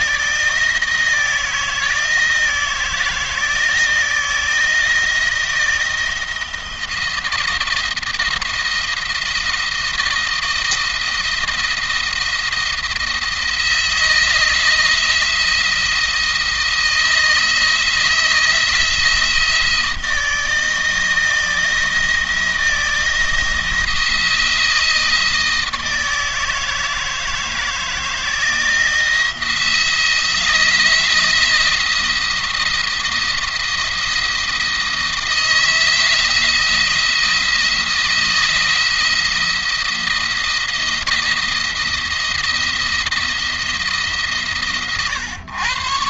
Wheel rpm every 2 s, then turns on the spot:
160, 160, 170, 170, 170, 170, 170, 160, 160, 160, 160, 170, 160, 160, 170, 170, 170, 170, 170, 170, 170, 170, 120.
none